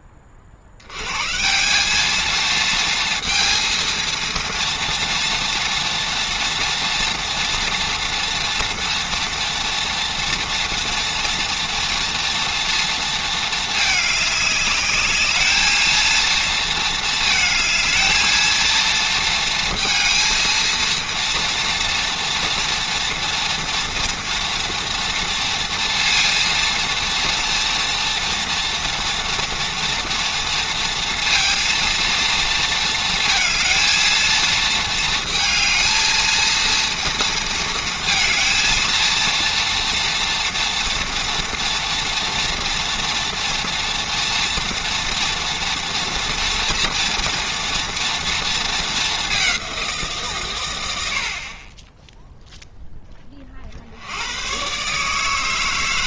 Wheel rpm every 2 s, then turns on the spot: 70, 230, 230, 240, 230, 230, 230, 210, 220, 220, 230, 230, 230, 230, 230, 230, 230, 220, 230, 230, 240, 230, 230, 240, 210, 90, 0, 150.
none